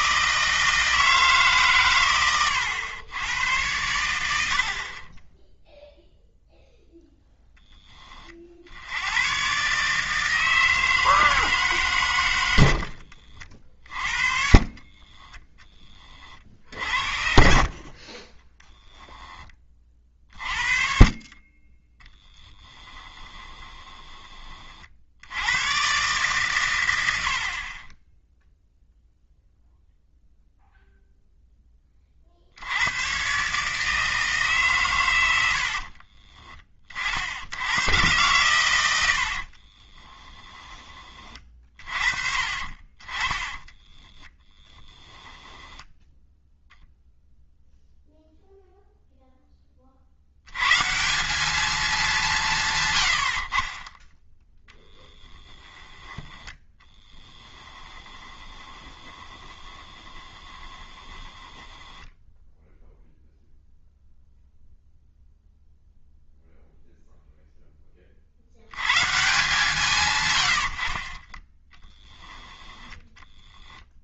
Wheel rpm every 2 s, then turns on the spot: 160, 100, 60, 0, 70, 160, 80, 40, 50, 10, 50, 10, 30, 110, 0, 0, 90, 130, 30, 100, 20, 40, 10, 0, 0, 120, 140, 10, 10, 20, 20, 0, 0, 0, 90, 80, 10.
12-18 20-24 44-46 58-62 70-72